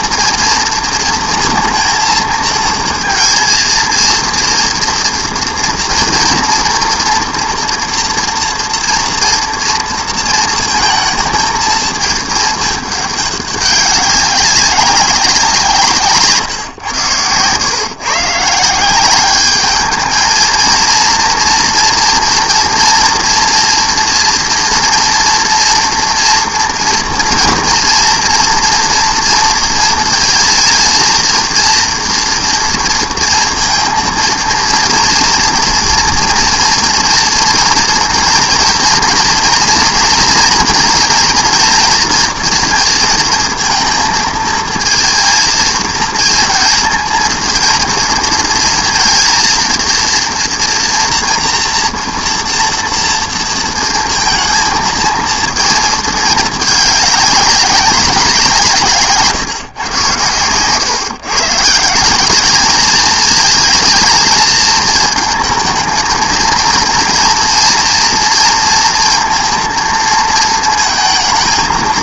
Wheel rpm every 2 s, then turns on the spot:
230, 230, 230, 230, 240, 230, 210, 190, 130, 170, 230, 230, 230, 230, 230, 230, 230, 230, 230, 220, 230, 230, 220, 230, 230, 230, 230, 220, 210, 160, 120, 210, 220, 230, 230, 220.
16-18